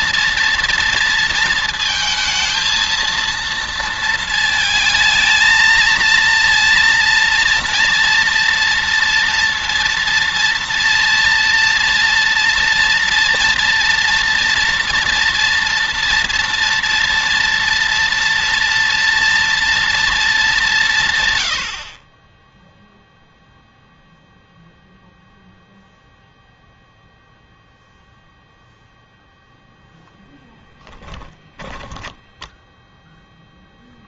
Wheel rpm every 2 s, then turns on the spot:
230, 230, 230, 230, 230, 230, 230, 230, 230, 230, 160, 0, 0, 0, 0, 10, 0.
30-32